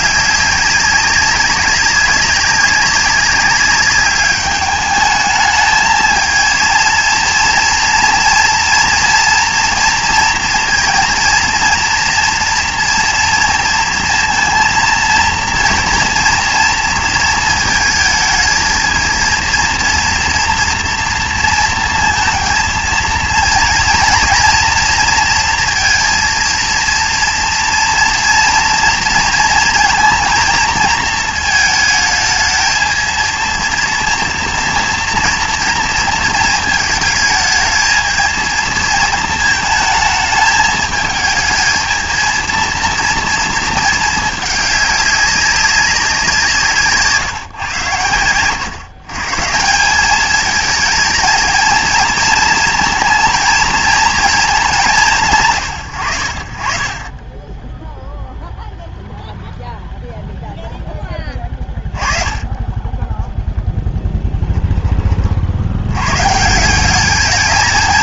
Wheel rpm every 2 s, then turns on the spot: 190, 190, 210, 230, 240, 230, 230, 230, 230, 230, 230, 230, 240, 230, 230, 230, 220, 230, 220, 220, 220, 230, 200, 170, 130, 220, 220, 200, 40, 0, 10, 20, 20, 190.
none